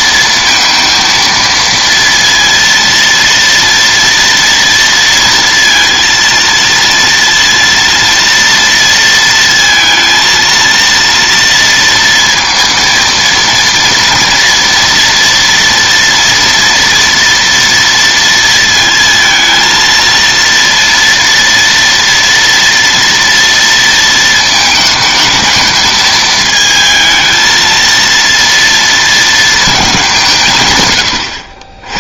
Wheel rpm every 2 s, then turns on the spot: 230, 230, 230, 230, 230, 230, 230, 230, 230, 230, 230, 240, 220, 220, 230, 130.
none